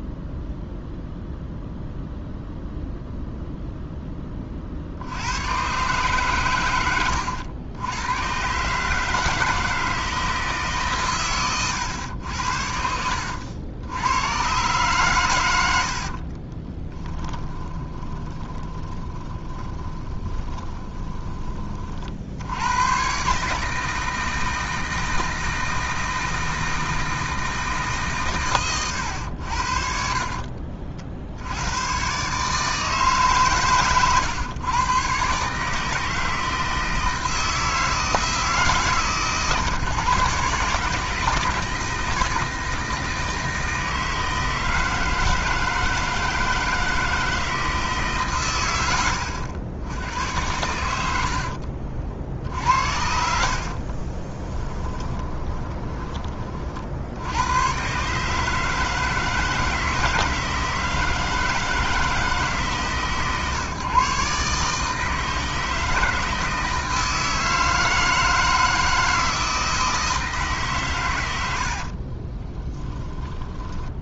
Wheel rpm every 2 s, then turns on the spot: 0, 0, 60, 100, 140, 140, 70, 130, 20, 20, 20, 110, 160, 160, 120, 50, 150, 120, 160, 150, 140, 160, 160, 160, 90, 90, 70, 20, 60, 160, 160, 140, 150, 160, 160, 130, 10.
12-14 16-22 54-56